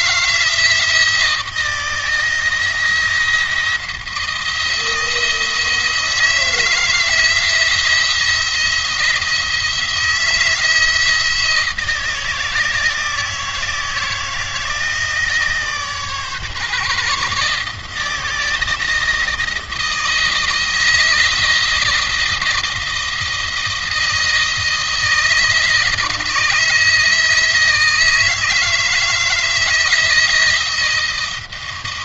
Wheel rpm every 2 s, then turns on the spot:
170, 160, 170, 160, 170, 170, 160, 160, 140, 160, 160, 170, 160, 160, 160, 160.
none